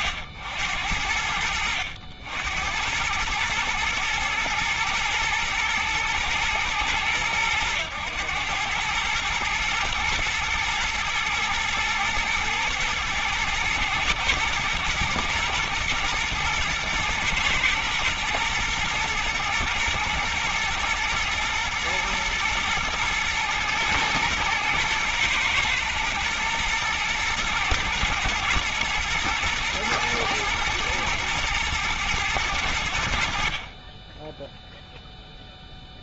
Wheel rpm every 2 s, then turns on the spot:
80, 80, 110, 110, 100, 110, 110, 110, 110, 110, 110, 110, 110, 110, 110, 110, 100, 10.
34-36